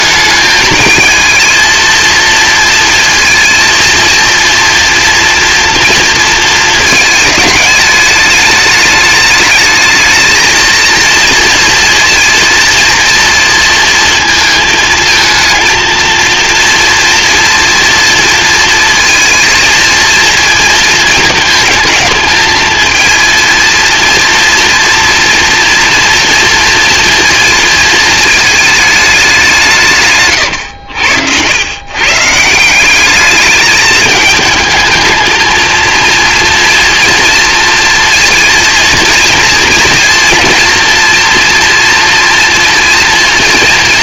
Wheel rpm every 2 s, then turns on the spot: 220, 230, 230, 220, 210, 230, 230, 220, 240, 230, 220, 220, 230, 230, 210, 80, 190, 220, 240, 230, 230, 230.
none